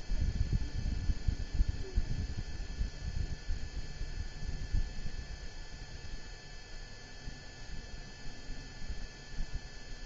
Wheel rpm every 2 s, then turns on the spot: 0, 0, 0, 0, 0.
none